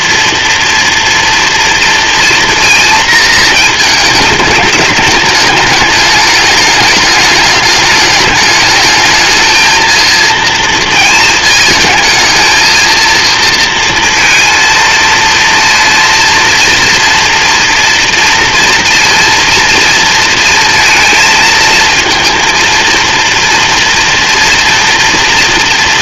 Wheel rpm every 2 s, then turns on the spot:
230, 230, 210, 210, 220, 230, 230, 230, 230, 230, 220, 230, 230.
none